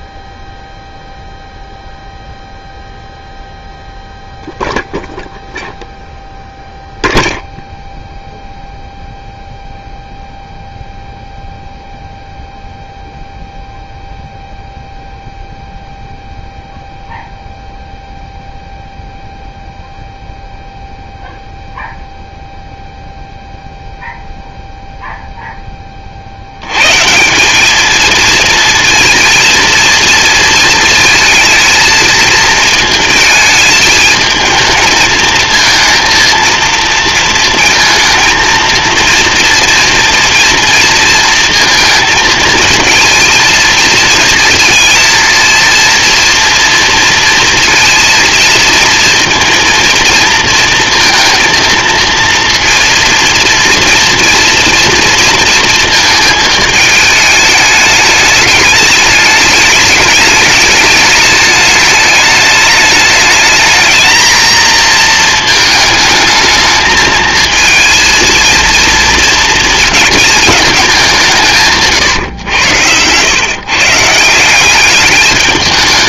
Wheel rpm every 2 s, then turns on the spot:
0, 0, 0, 0, 0, 0, 0, 0, 0, 0, 0, 0, 0, 20, 210, 230, 220, 220, 220, 230, 230, 230, 220, 230, 230, 230, 230, 230, 230, 210, 210, 210, 220, 220, 230, 220, 150, 130.
72-74